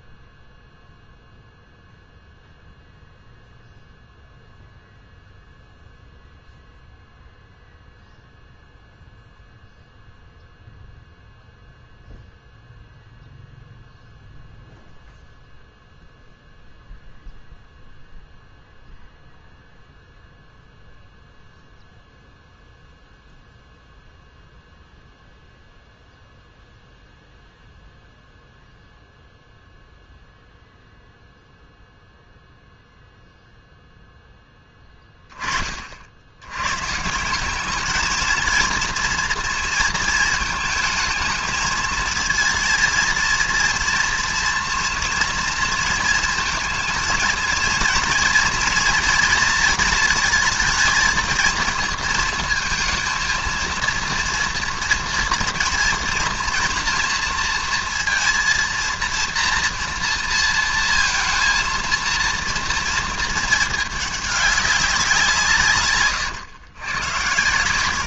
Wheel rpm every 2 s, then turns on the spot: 0, 0, 0, 0, 0, 0, 0, 0, 0, 0, 0, 0, 0, 0, 0, 0, 0, 10, 120, 230, 220, 230, 230, 230, 230, 220, 230, 230, 230, 230, 230, 230, 200, 120.
none